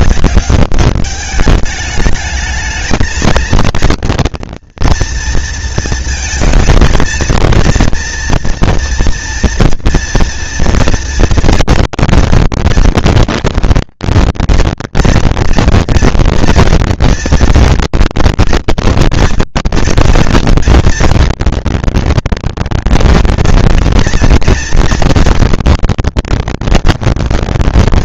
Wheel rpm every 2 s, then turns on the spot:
200, 220, 230, 220, 230, 230, 230, 230, 230, 230, 230, 230, 230, 230.
none